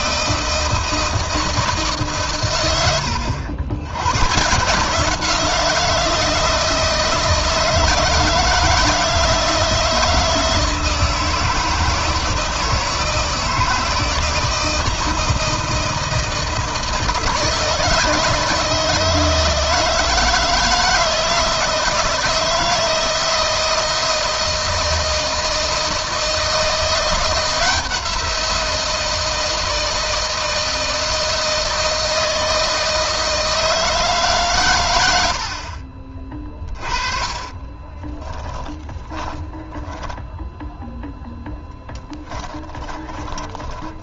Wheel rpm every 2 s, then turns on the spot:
160, 100, 160, 160, 160, 160, 160, 160, 160, 160, 160, 170, 160, 170, 170, 160, 160, 100, 20, 20, 10, 20.
36-44